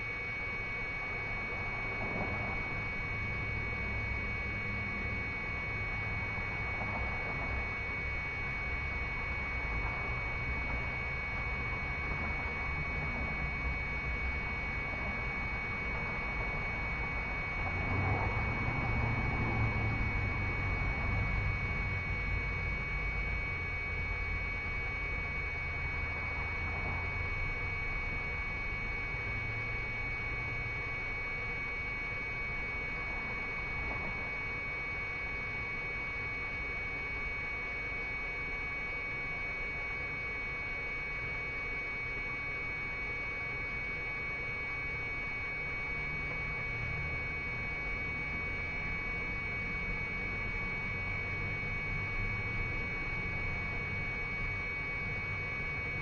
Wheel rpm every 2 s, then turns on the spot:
0, 0, 0, 0, 0, 0, 0, 0, 0, 0, 0, 0, 0, 0, 0, 0, 0, 0, 0, 0, 0, 0, 0, 0, 0, 0, 0, 0.
none